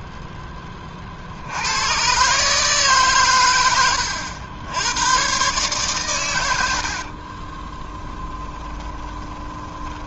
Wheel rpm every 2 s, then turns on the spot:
20, 140, 90, 80, 20.
8-10